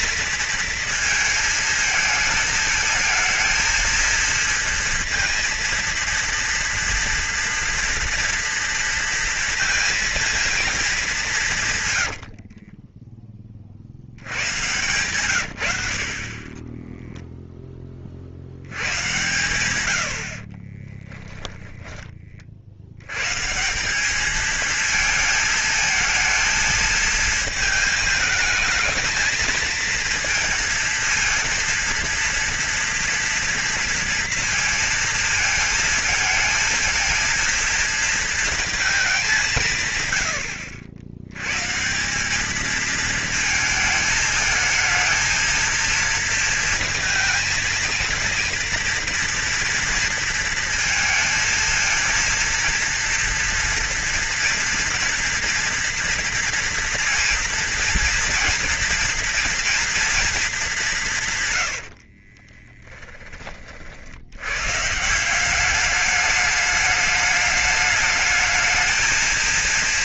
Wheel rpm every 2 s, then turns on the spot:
230, 220, 230, 230, 230, 220, 40, 110, 20, 90, 30, 60, 220, 230, 220, 230, 230, 230, 230, 230, 90, 220, 220, 220, 230, 230, 230, 230, 230, 230, 230, 40, 130, 210, 220.
12-14 20-22 62-64